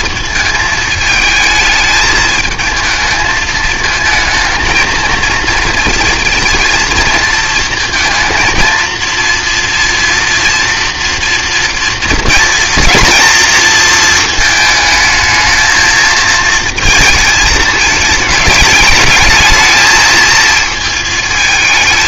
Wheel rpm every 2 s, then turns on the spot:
220, 220, 230, 230, 230, 230, 230, 220, 230, 220, 220.
none